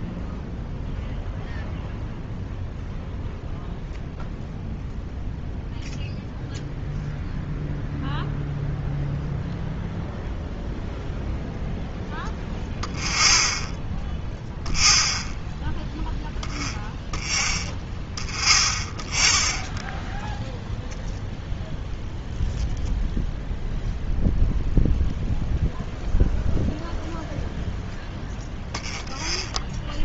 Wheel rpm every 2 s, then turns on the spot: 0, 0, 0, 0, 0, 0, 0, 0, 0, 0, 0, 0, 0, 0, 0.
none